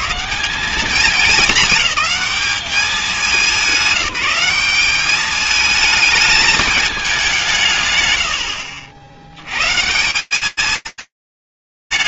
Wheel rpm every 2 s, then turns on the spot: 200, 210, 200, 220, 80, 190.
none